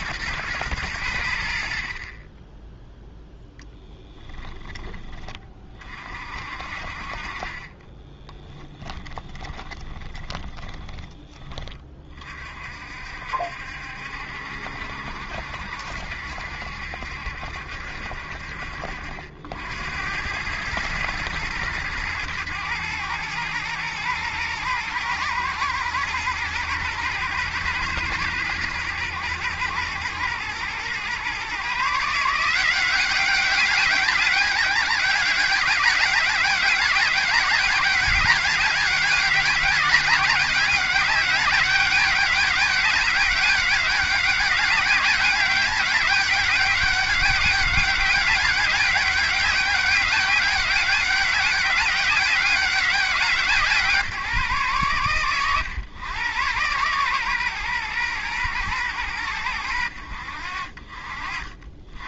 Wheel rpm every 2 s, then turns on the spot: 110, 10, 10, 50, 10, 20, 40, 70, 70, 60, 110, 110, 110, 120, 110, 110, 180, 200, 200, 200, 190, 200, 200, 200, 200, 200, 200, 140, 120, 110, 60.
8-12